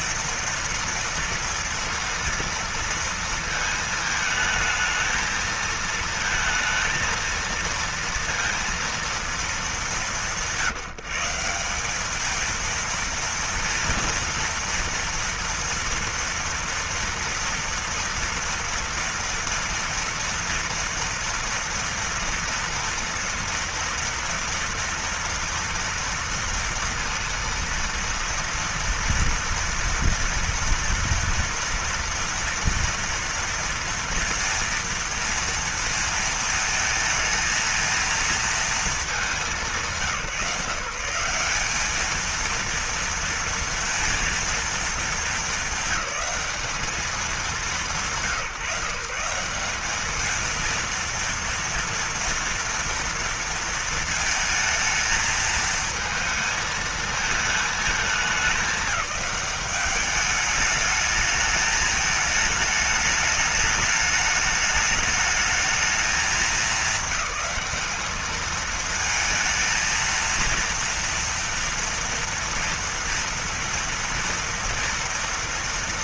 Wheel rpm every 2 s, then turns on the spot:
230, 230, 220, 230, 230, 170, 230, 230, 230, 230, 230, 230, 230, 230, 230, 230, 230, 230, 220, 220, 160, 230, 220, 210, 170, 230, 230, 220, 220, 200, 210, 220, 210, 220, 220, 230, 230, 230.
none